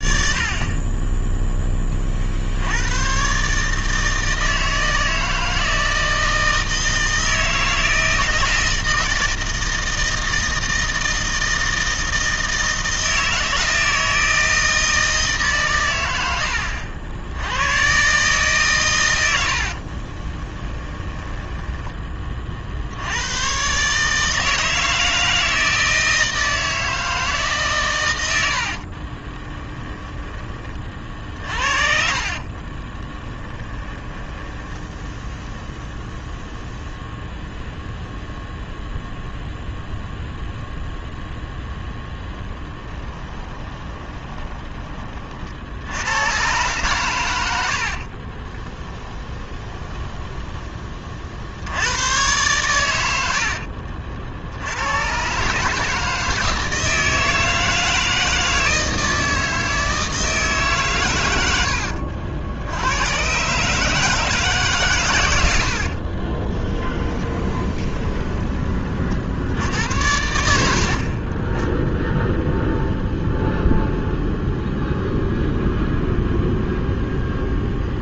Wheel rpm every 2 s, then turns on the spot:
20, 110, 160, 160, 160, 160, 160, 160, 70, 110, 10, 80, 160, 160, 50, 40, 20, 10, 0, 0, 0, 10, 30, 120, 10, 30, 110, 90, 160, 160, 130, 90, 130, 10, 40, 60, 0, 0, 0.
20-22 28-36 42-44 48-50 66-68